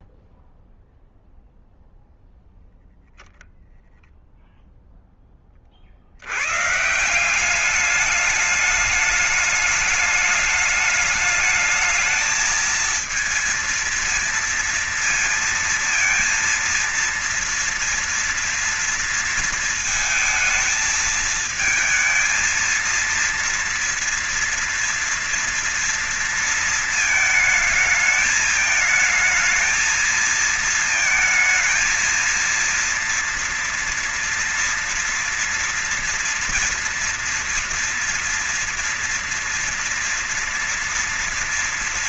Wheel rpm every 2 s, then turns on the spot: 0, 0, 0, 120, 210, 210, 220, 230, 230, 230, 220, 230, 230, 230, 220, 220, 230, 230, 230, 230, 230.
none